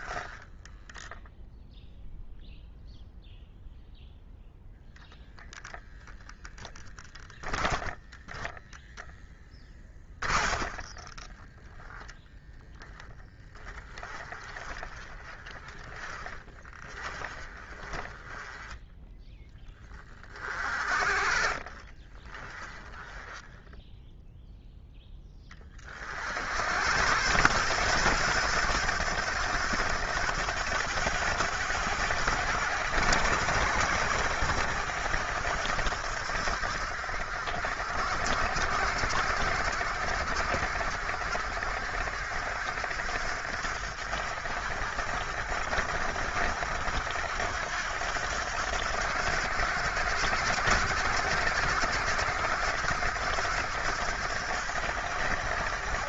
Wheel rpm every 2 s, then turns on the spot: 0, 0, 0, 10, 10, 20, 20, 30, 30, 10, 30, 10, 20, 110, 100, 90, 90, 80, 60, 60, 60, 60, 60, 70, 80, 80, 80, 70.
6-18 20-24